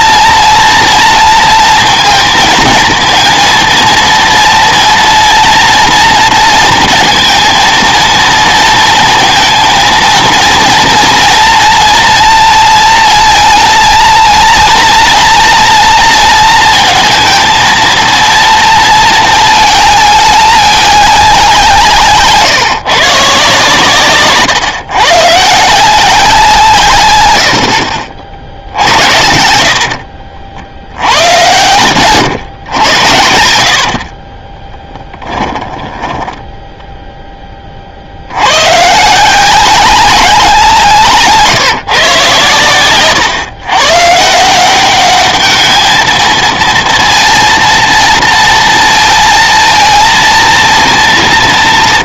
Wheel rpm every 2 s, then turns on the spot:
230, 230, 230, 230, 230, 230, 230, 230, 230, 230, 210, 140, 140, 140, 70, 80, 120, 10, 0, 130, 170, 110, 180, 230, 230, 230.
34-36